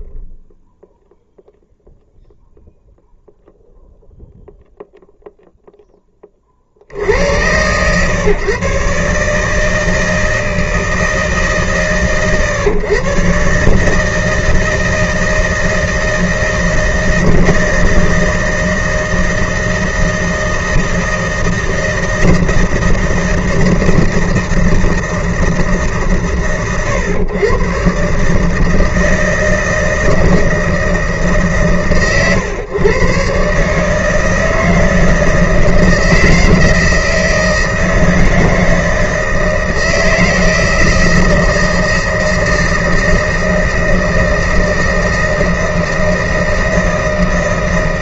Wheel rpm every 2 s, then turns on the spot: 0, 0, 0, 30, 130, 160, 120, 160, 160, 160, 160, 160, 160, 120, 150, 160, 120, 160, 160, 160, 160, 160, 160, 160.
none